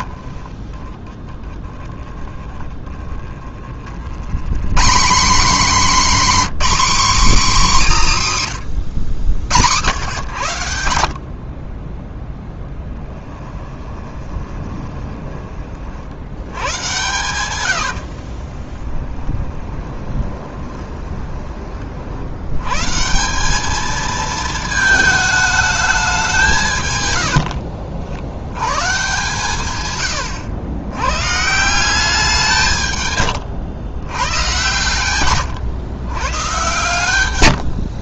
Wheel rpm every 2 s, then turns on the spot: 20, 20, 170, 260, 110, 80, 10, 20, 120, 20, 20, 140, 220, 120, 130, 110, 130, 130, 120.
0-2 12-16 18-22